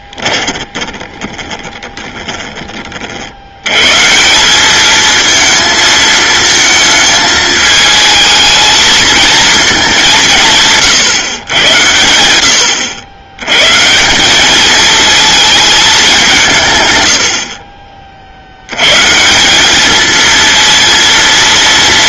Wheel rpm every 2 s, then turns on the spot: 30, 40, 210, 220, 220, 140, 80, 220, 130, 110, 230.
0-2